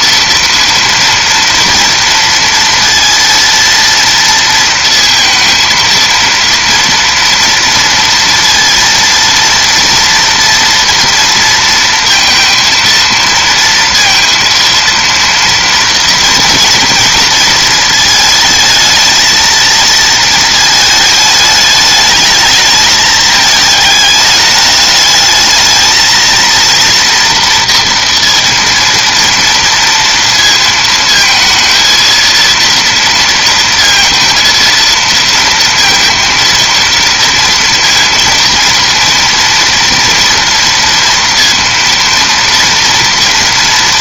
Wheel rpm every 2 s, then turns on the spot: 230, 230, 230, 230, 230, 230, 230, 230, 230, 220, 220, 210, 210, 230, 230, 230, 230, 230, 230, 230, 230, 230.
none